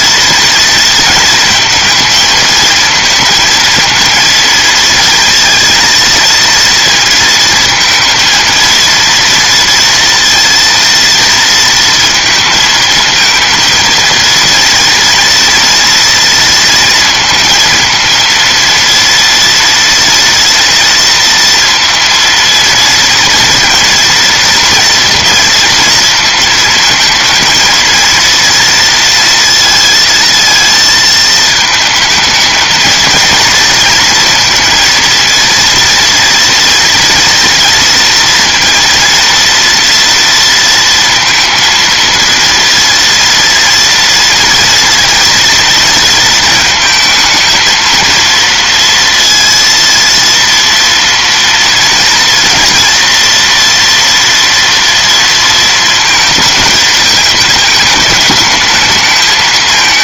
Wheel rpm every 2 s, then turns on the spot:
230, 220, 230, 230, 230, 230, 230, 230, 230, 230, 230, 230, 230, 220, 230, 220, 220, 230, 230, 230, 230, 230, 230, 220, 230, 230, 230, 230, 220, 210.
none